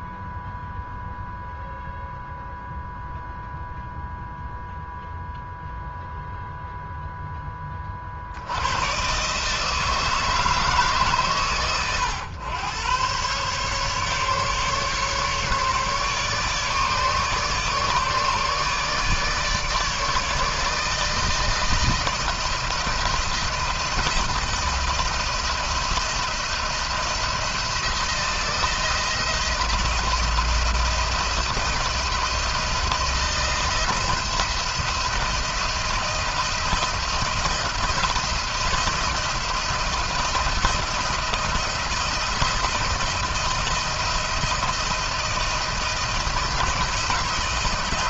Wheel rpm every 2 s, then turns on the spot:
0, 0, 0, 0, 90, 150, 110, 140, 150, 150, 160, 170, 160, 170, 160, 170, 170, 170, 160, 170, 170, 170, 170, 170.
none